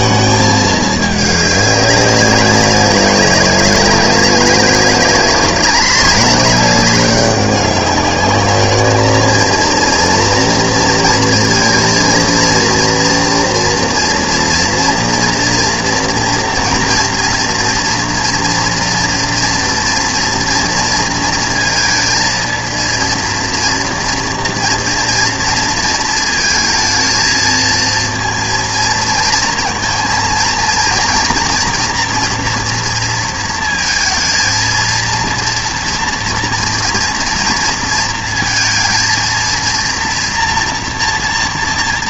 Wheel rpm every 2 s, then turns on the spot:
220, 190, 190, 200, 210, 230, 230, 230, 240, 230, 230, 230, 230, 220, 230, 230, 240, 230, 230, 230, 230.
none